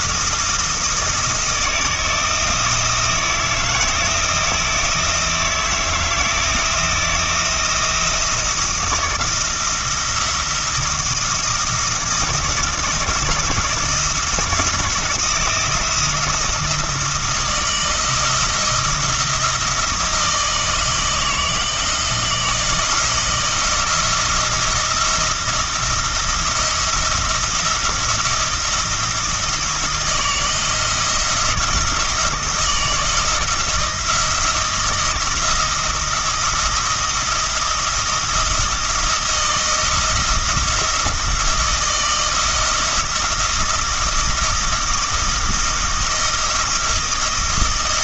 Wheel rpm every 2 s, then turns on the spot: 160, 160, 160, 160, 170, 170, 170, 170, 170, 170, 160, 160, 170, 170, 170, 170, 170, 170, 170, 170, 170, 160, 170, 160.
none